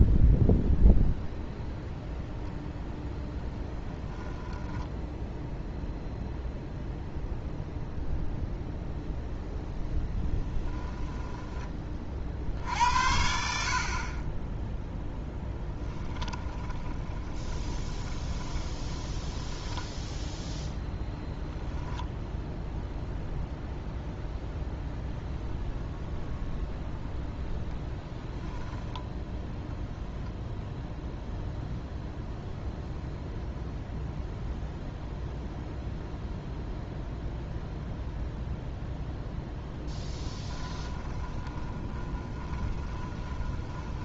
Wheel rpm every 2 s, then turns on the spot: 0, 0, 10, 0, 0, 20, 60, 10, 20, 20, 0, 0, 0, 0, 0, 0, 0, 0, 0, 0, 20, 20.
4-6 10-12 16-20 40-44